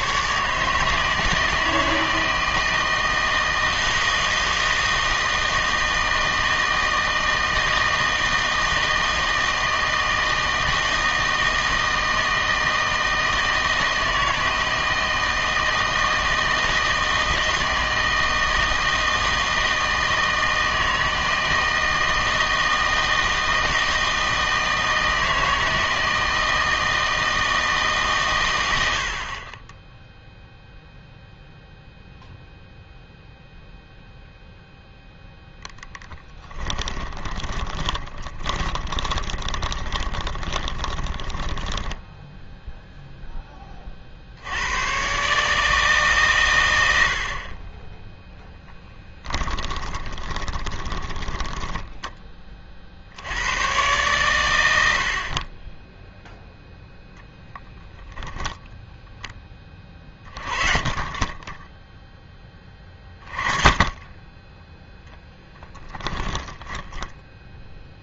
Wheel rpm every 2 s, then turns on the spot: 150, 160, 160, 160, 160, 160, 160, 160, 160, 160, 160, 160, 160, 160, 100, 0, 0, 0, 10, 20, 20, 0, 90, 100, 10, 20, 20, 100, 0, 0, 30, 20, 10, 10.
36-42 48-52 66-68